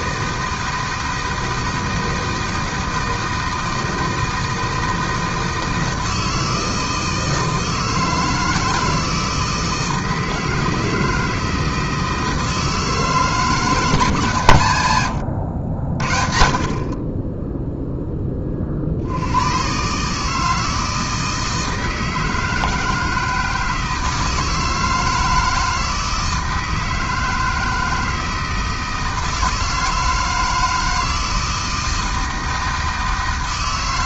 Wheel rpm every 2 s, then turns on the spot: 160, 160, 160, 160, 160, 160, 160, 110, 50, 40, 160, 160, 160, 160, 160, 160, 160.
none